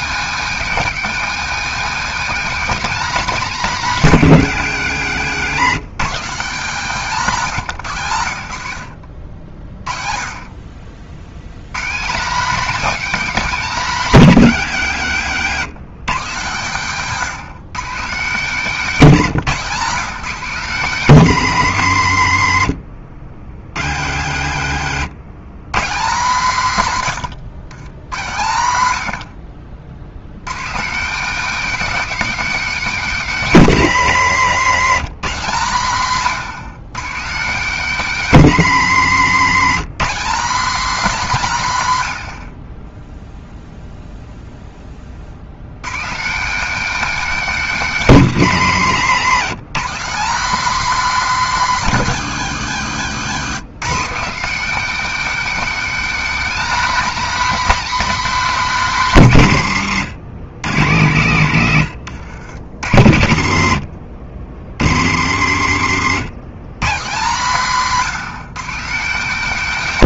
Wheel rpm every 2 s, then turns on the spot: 190, 210, 120, 190, 60, 60, 250, 120, 170, 190, 180, 60, 90, 150, 90, 200, 240, 160, 170, 150, 230, 20, 30, 240, 150, 240, 190, 250, 270, 220, 120, 90, 90, 160, 180.
16-18 24-26